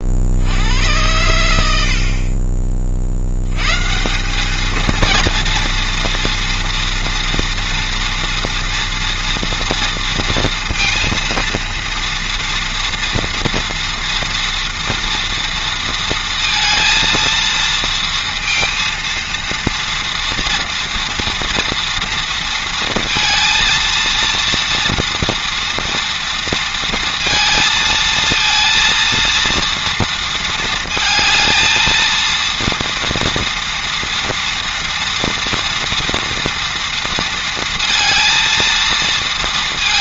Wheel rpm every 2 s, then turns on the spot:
100, 40, 220, 230, 240, 230, 230, 230, 230, 230, 230, 230, 230, 230, 230, 230, 230, 230, 230, 230.
none